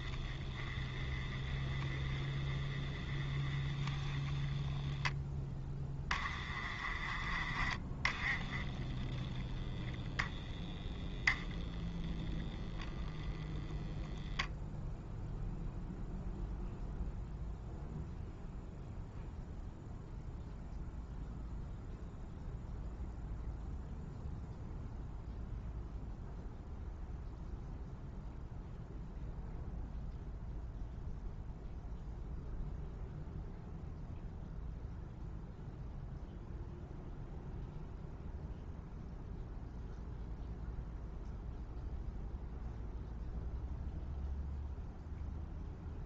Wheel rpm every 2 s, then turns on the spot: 20, 20, 10, 20, 10, 10, 0, 0, 0, 0, 0, 0, 0, 0, 0, 0, 0, 0, 0, 0, 0, 0, 0.
none